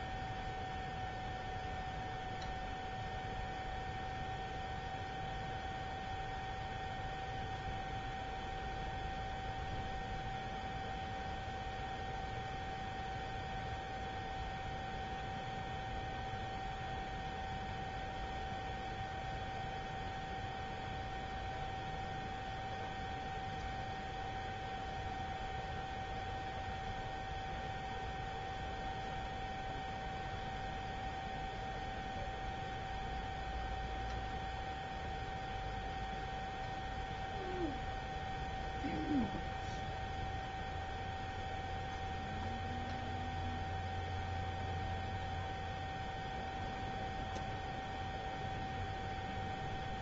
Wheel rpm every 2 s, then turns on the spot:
0, 0, 0, 0, 0, 0, 0, 0, 0, 0, 0, 0, 0, 0, 0, 0, 0, 0, 0, 0, 0, 0, 0, 0, 0.
none